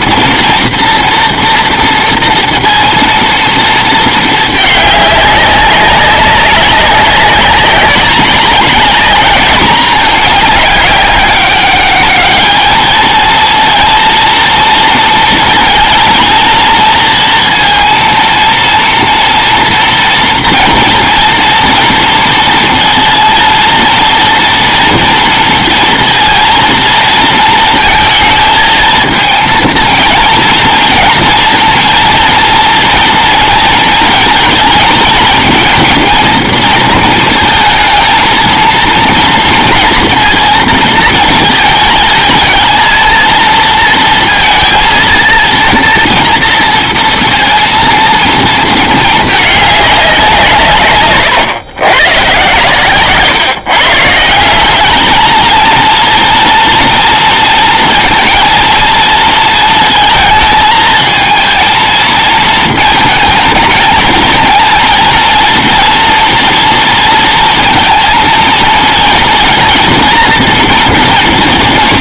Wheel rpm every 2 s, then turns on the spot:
230, 230, 220, 190, 200, 210, 210, 230, 230, 230, 230, 230, 230, 230, 220, 230, 230, 220, 230, 230, 230, 220, 230, 230, 220, 170, 130, 180, 230, 230, 220, 220, 230, 230, 230, 230.
none